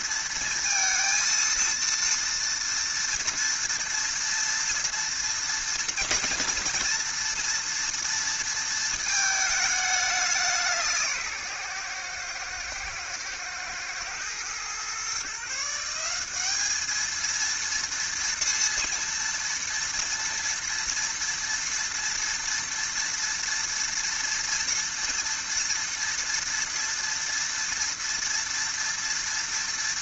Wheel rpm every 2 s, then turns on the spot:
230, 230, 230, 230, 230, 170, 110, 130, 220, 230, 230, 230, 230, 230, 230.
none